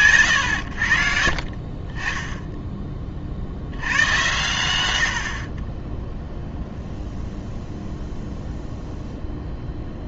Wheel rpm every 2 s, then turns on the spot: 80, 20, 90, 0, 0.
none